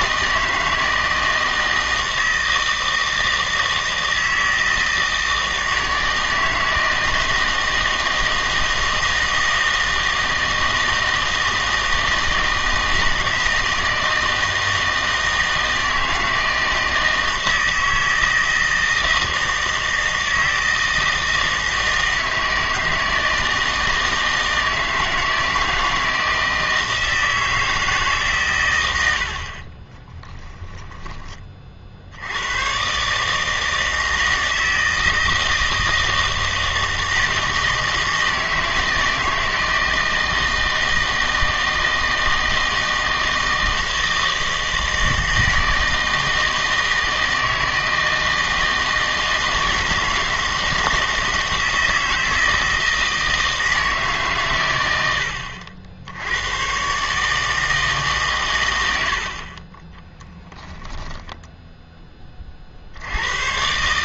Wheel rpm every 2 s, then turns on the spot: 160, 160, 160, 160, 160, 160, 160, 160, 160, 160, 160, 160, 160, 160, 90, 10, 120, 160, 160, 160, 160, 160, 160, 160, 160, 160, 160, 100, 120, 90, 10, 50.
none